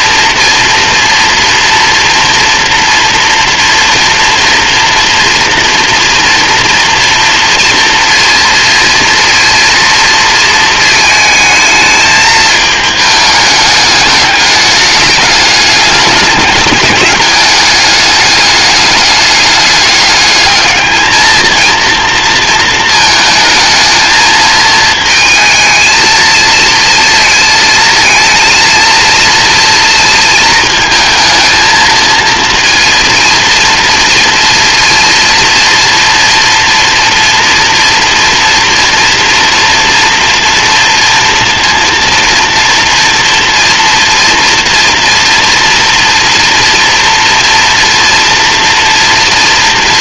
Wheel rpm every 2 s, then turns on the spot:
230, 230, 230, 240, 230, 220, 210, 210, 200, 210, 220, 220, 220, 230, 230, 220, 230, 230, 230, 230, 230, 230, 230, 230, 230.
none